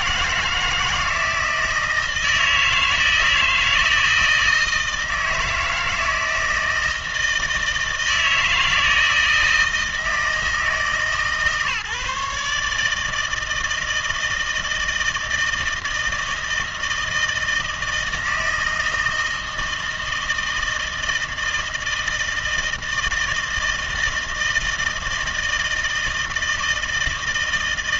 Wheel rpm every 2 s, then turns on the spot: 160, 160, 160, 160, 160, 160, 150, 160, 160, 160, 160, 160, 160, 160.
none